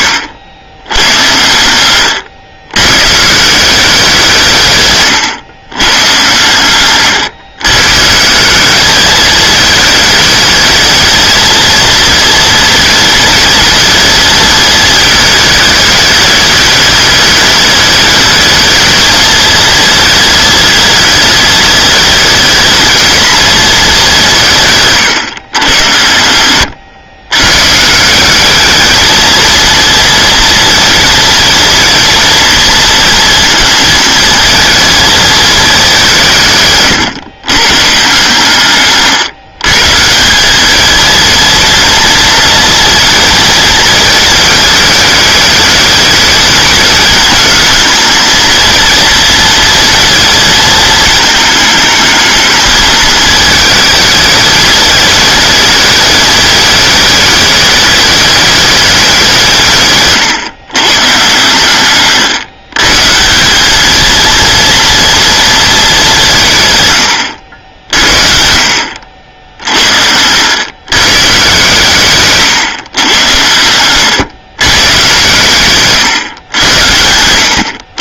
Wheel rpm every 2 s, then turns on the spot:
100, 120, 130, 120, 210, 220, 230, 220, 210, 220, 220, 220, 140, 100, 220, 230, 230, 230, 140, 140, 220, 230, 210, 210, 230, 220, 220, 220, 220, 200, 130, 150, 230, 110, 70, 120, 120, 110, 90.
none